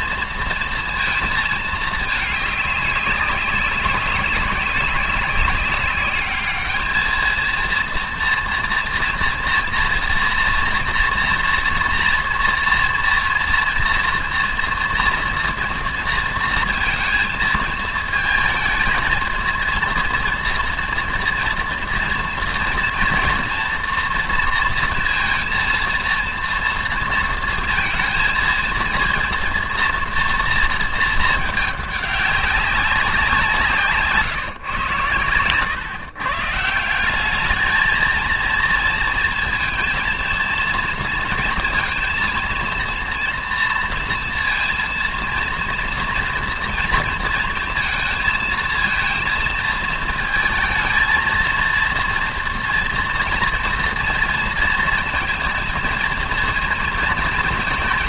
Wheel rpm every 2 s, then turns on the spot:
230, 210, 200, 210, 230, 230, 230, 230, 230, 220, 230, 230, 230, 230, 230, 230, 200, 140, 150, 230, 230, 230, 230, 230, 220, 220, 230, 230, 230.
none